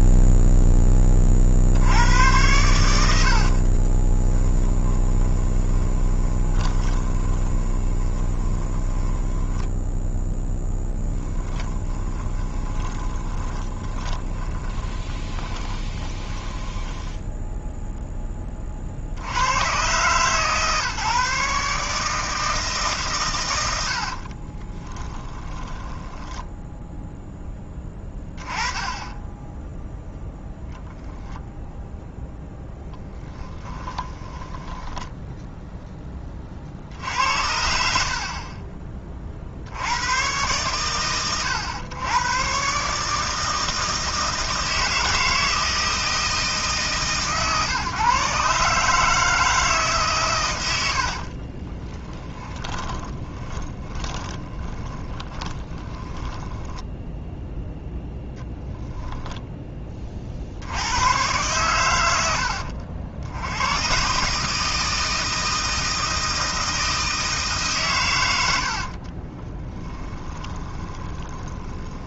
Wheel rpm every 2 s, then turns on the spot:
10, 90, 10, 20, 20, 10, 20, 20, 10, 40, 150, 150, 10, 0, 10, 0, 10, 10, 50, 30, 90, 130, 160, 150, 150, 110, 20, 20, 10, 10, 80, 70, 150, 160, 70, 20.
4-18 24-26 34-36 52-60 68-72